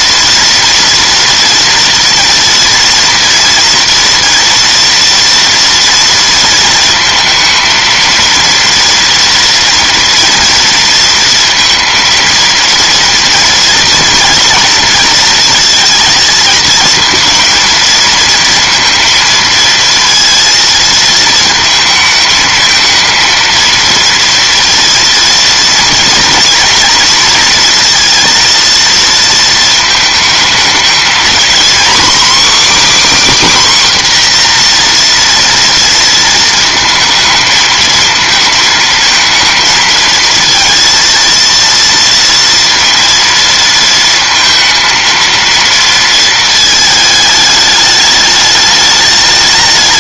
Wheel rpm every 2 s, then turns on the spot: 230, 230, 240, 230, 230, 230, 230, 230, 230, 230, 230, 220, 230, 230, 230, 220, 280, 240, 220, 220, 230, 230, 230, 220, 210.
none